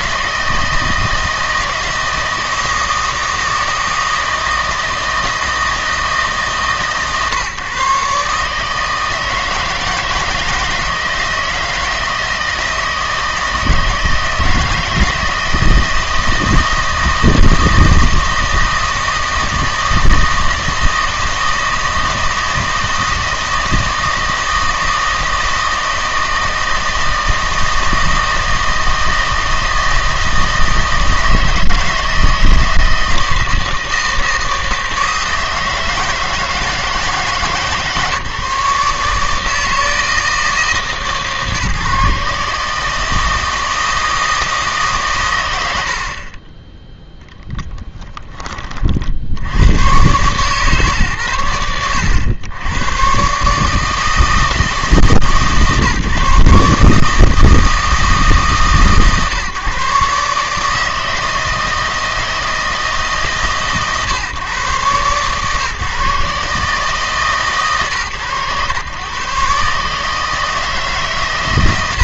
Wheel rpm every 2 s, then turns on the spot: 160, 160, 160, 140, 150, 160, 160, 160, 160, 160, 160, 160, 160, 160, 160, 160, 160, 160, 160, 140, 160, 150, 150, 20, 40, 130, 100, 160, 140, 140, 150, 160, 130, 140, 120, 150.
none